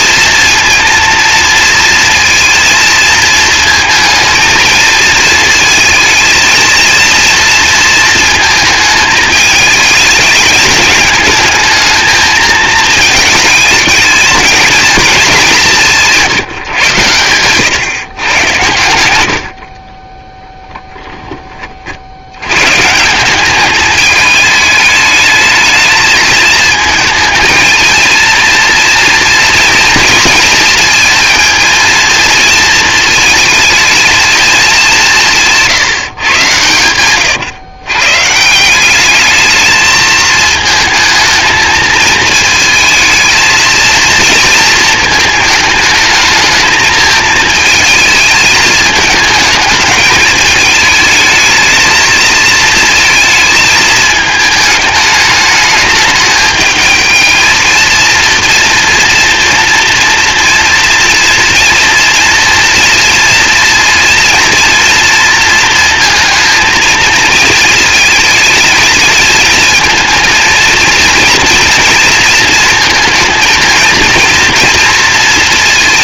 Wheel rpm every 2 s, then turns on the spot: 230, 230, 220, 230, 220, 210, 220, 220, 130, 100, 0, 160, 220, 220, 230, 220, 230, 200, 110, 190, 220, 220, 230, 220, 220, 220, 230, 210, 220, 230, 230, 230, 230, 230, 220, 230, 220, 230.
none